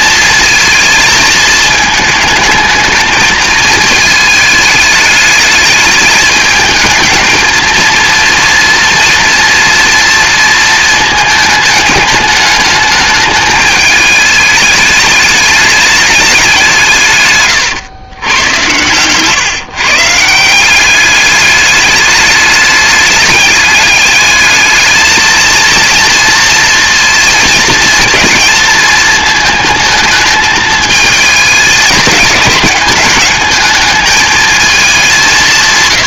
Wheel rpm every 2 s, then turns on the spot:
220, 220, 210, 220, 230, 230, 210, 210, 150, 120, 200, 210, 220, 230, 230, 220, 210, 210.
none